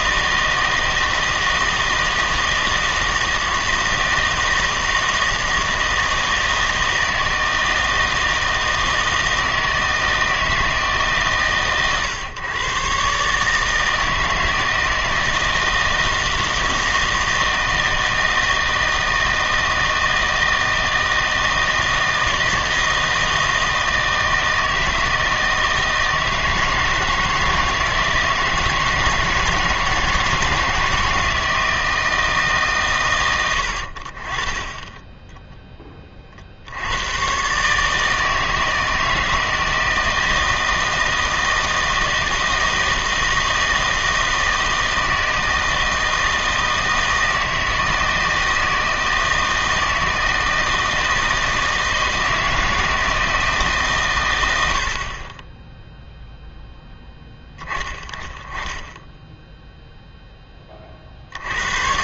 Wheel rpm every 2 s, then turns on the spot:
160, 160, 160, 160, 160, 150, 130, 160, 160, 160, 160, 160, 160, 160, 160, 160, 130, 10, 80, 160, 160, 160, 160, 160, 160, 160, 160, 60, 0, 10, 50.
none